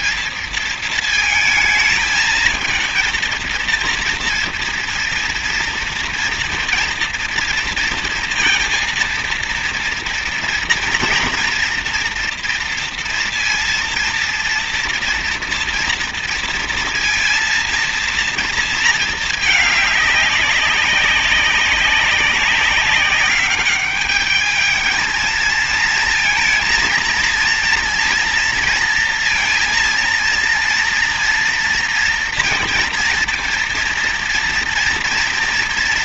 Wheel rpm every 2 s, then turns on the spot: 220, 230, 230, 230, 230, 230, 230, 230, 230, 220, 200, 200, 220, 230, 230, 230, 230, 230.
none